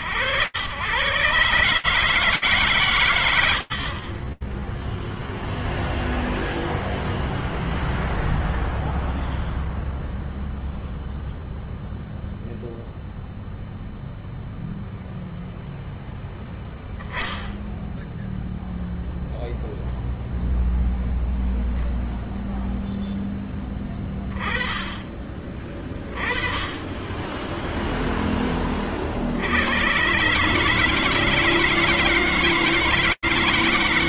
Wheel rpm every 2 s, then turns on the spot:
140, 110, 0, 0, 0, 0, 0, 0, 0, 0, 0, 0, 20, 20, 20, 150, 160.
none